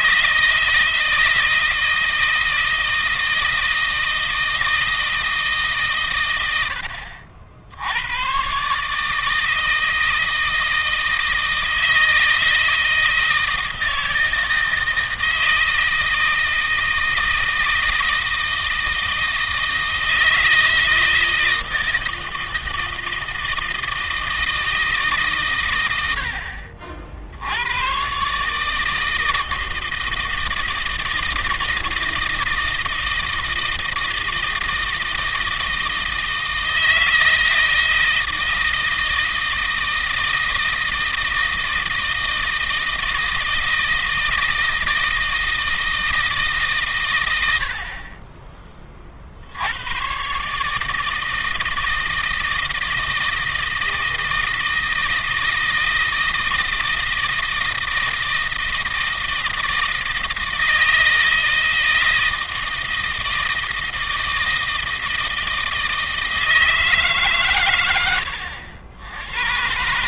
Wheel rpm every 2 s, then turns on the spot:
160, 160, 160, 80, 150, 160, 160, 160, 160, 160, 160, 160, 150, 70, 160, 160, 160, 160, 160, 160, 160, 160, 160, 120, 50, 160, 160, 160, 160, 160, 160, 160, 160, 140, 90.
none